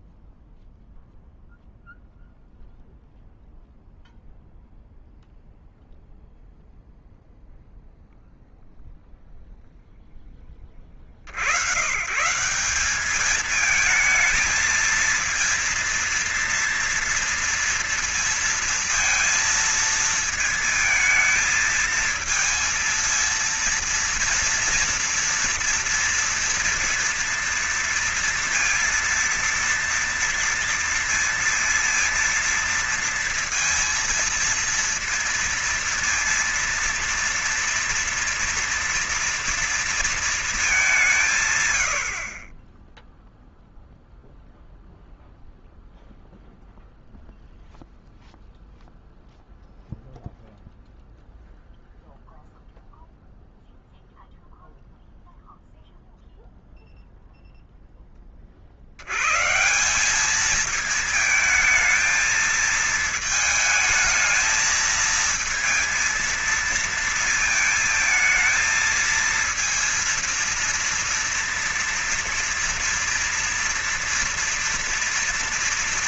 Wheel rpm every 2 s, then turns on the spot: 0, 0, 0, 0, 0, 20, 170, 230, 230, 230, 230, 230, 230, 240, 230, 230, 230, 230, 230, 230, 220, 40, 0, 0, 0, 0, 0, 0, 0, 30, 200, 220, 220, 230, 220, 230, 230, 230.
none